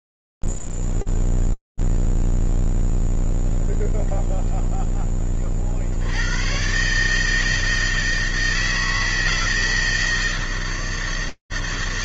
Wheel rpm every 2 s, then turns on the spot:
0, 0, 0, 80, 160, 160.
none